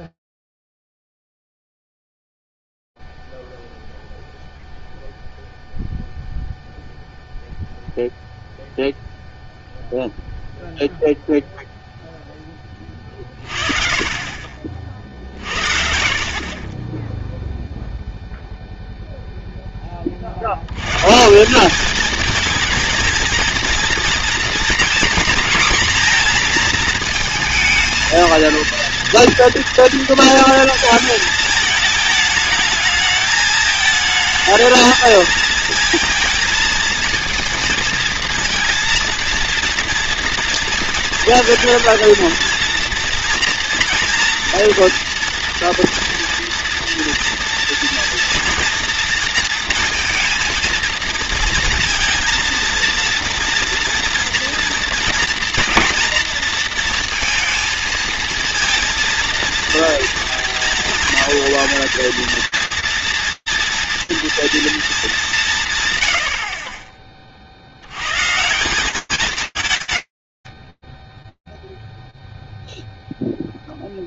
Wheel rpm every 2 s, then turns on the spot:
0, 0, 0, 0, 0, 0, 20, 60, 20, 0, 120, 230, 230, 230, 240, 230, 210, 230, 230, 230, 230, 230, 230, 230, 230, 230, 230, 240, 230, 230, 230, 230, 200, 40, 150, 10, 0.
none